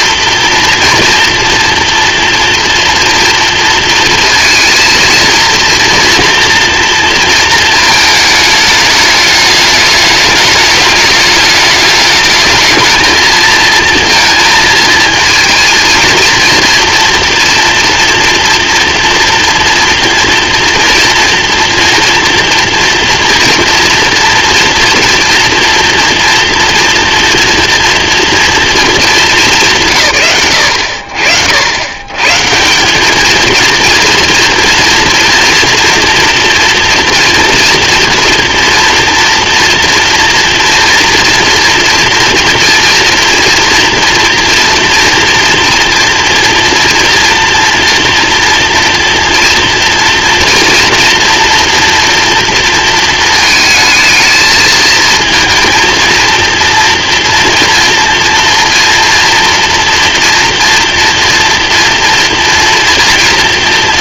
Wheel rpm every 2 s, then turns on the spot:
230, 230, 230, 230, 210, 210, 220, 230, 230, 230, 230, 240, 230, 240, 230, 70, 180, 240, 230, 240, 230, 230, 230, 230, 230, 230, 230, 220, 230, 240, 230, 230.
none